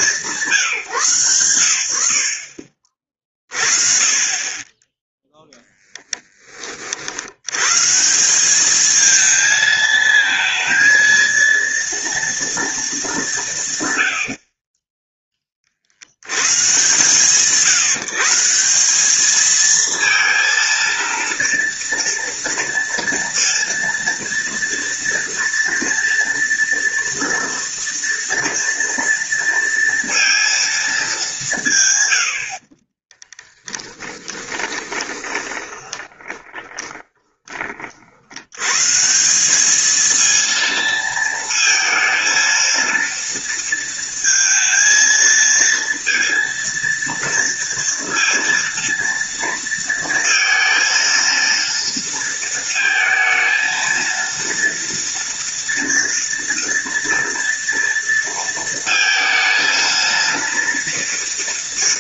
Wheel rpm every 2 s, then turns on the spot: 160, 40, 10, 30, 200, 230, 230, 40, 130, 180, 230, 230, 230, 230, 230, 230, 50, 20, 20, 110, 230, 230, 220, 230, 230, 230, 230, 230, 230, 230, 230.
32-38